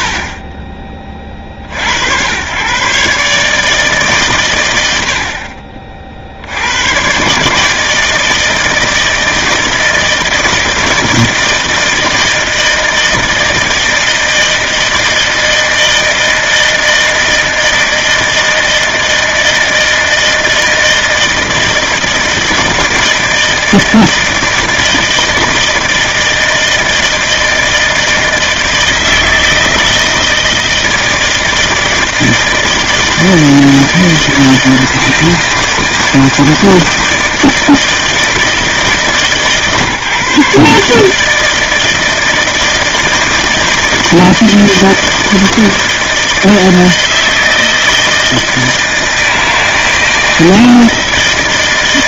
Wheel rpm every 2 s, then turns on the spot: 60, 150, 40, 150, 160, 160, 160, 160, 160, 160, 160, 160, 160, 160, 160, 160, 160, 160, 160, 150, 160, 160, 160, 160, 160, 160.
none